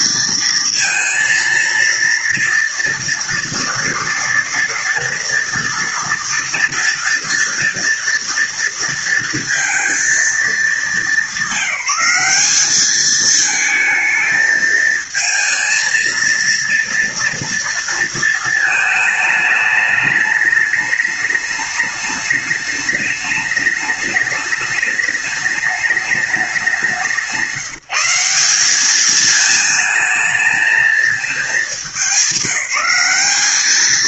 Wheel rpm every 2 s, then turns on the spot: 220, 230, 230, 230, 230, 210, 200, 220, 230, 220, 210, 210, 210, 190, 200, 220, 190.
none